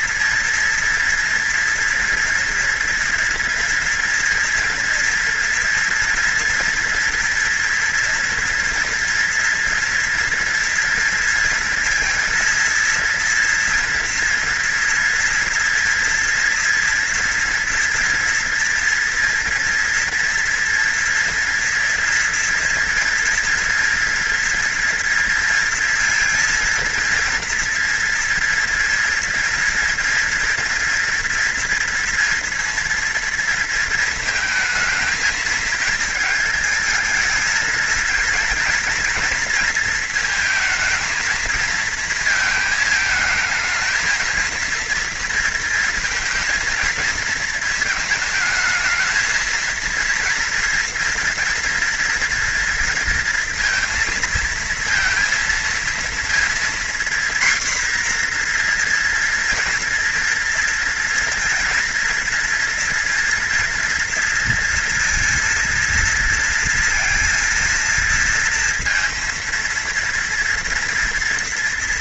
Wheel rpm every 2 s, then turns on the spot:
230, 230, 230, 230, 230, 230, 230, 230, 230, 230, 230, 230, 230, 230, 230, 230, 230, 220, 220, 230, 220, 220, 230, 230, 220, 230, 230, 230, 240, 240, 230, 240, 230, 230, 230, 240.
none